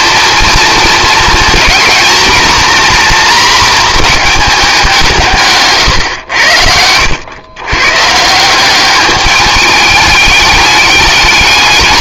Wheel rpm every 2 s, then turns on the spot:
230, 240, 190, 80, 190, 210.
none